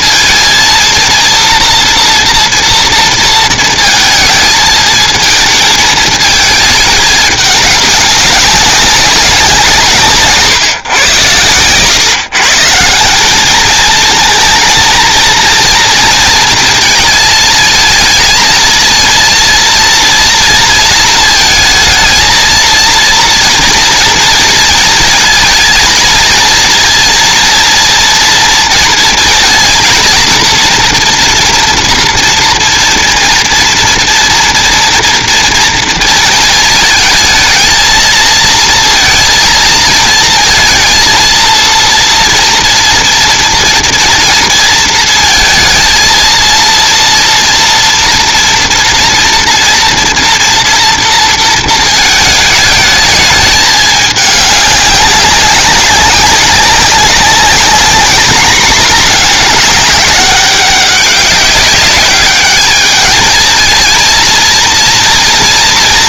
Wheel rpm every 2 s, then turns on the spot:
230, 220, 220, 200, 160, 130, 220, 230, 220, 230, 230, 230, 220, 230, 230, 230, 230, 230, 230, 230, 230, 230, 230, 230, 230, 220, 210, 190, 200, 200, 200, 220, 230.
none